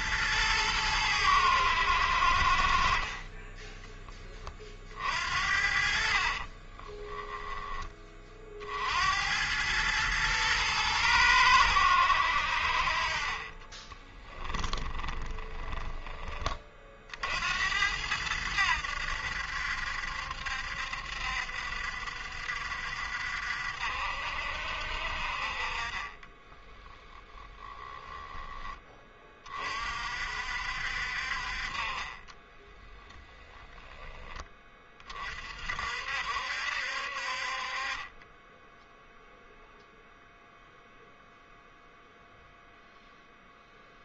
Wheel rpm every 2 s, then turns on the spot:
110, 40, 30, 30, 50, 110, 60, 20, 30, 90, 70, 60, 60, 10, 10, 60, 10, 20, 60, 10, 0, 0.
6-8 14-16 26-28 32-34